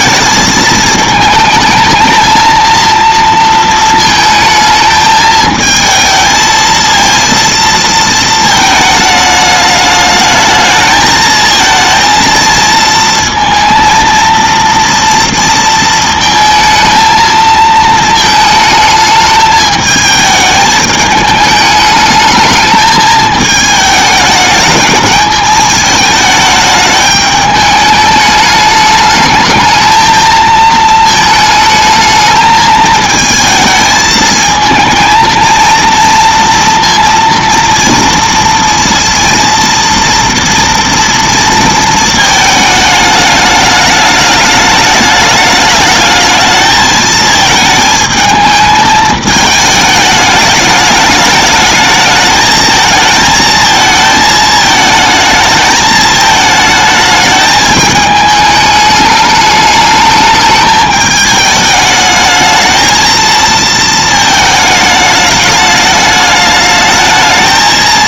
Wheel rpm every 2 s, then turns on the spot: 220, 230, 220, 230, 220, 220, 230, 230, 220, 220, 210, 210, 210, 210, 210, 220, 220, 220, 230, 230, 230, 220, 210, 220, 220, 210, 220, 220, 220, 210, 210, 220, 220, 210.
none